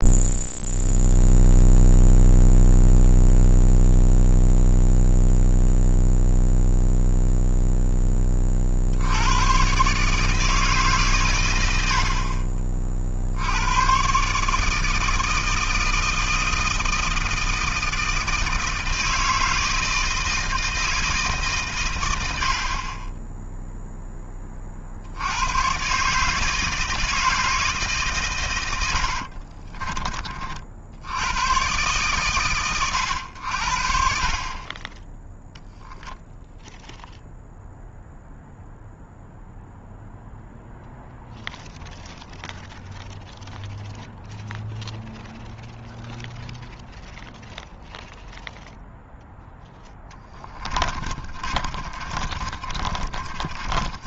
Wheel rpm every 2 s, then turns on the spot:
0, 0, 0, 0, 90, 130, 50, 160, 160, 160, 160, 20, 80, 160, 60, 90, 100, 10, 0, 0, 0, 0, 0, 0, 0, 30, 30.
28-30 50-54